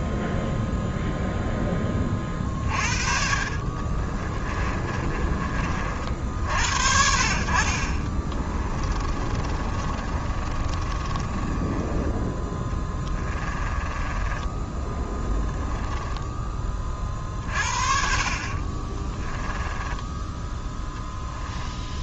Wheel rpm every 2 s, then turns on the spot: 0, 50, 30, 60, 30, 30, 10, 10, 30, 30, 10.
2-6 8-14 18-20